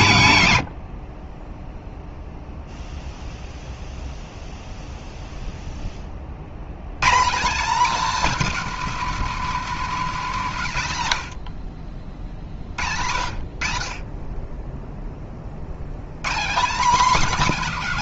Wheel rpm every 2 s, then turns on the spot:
130, 0, 0, 110, 250, 160, 60, 20, 210.
none